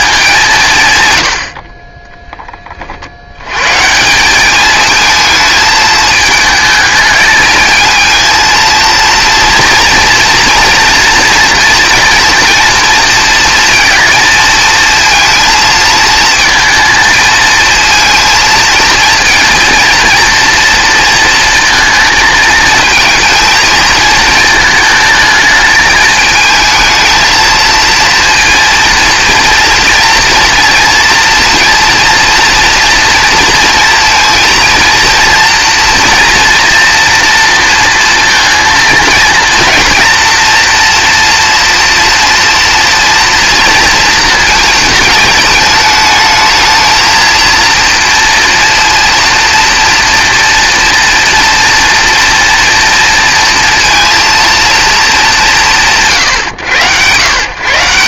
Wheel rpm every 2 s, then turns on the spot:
160, 20, 210, 220, 230, 230, 230, 220, 220, 230, 230, 220, 220, 220, 230, 230, 230, 230, 230, 230, 230, 230, 230, 220, 230, 240, 230, 230, 130.
none